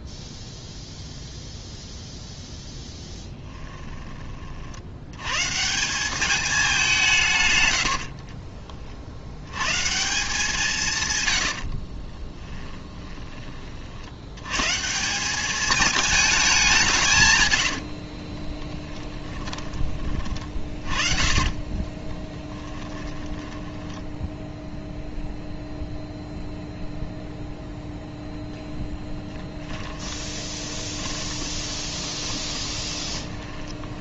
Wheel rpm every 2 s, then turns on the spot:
0, 0, 60, 190, 40, 160, 20, 150, 180, 20, 20, 20, 0, 0, 10, 20, 20.
12-14 18-24 30-34